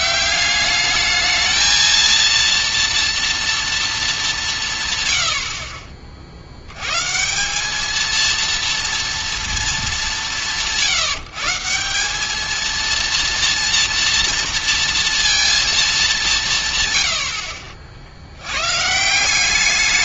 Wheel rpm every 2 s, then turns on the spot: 200, 230, 160, 90, 230, 170, 220, 230, 190, 130.
none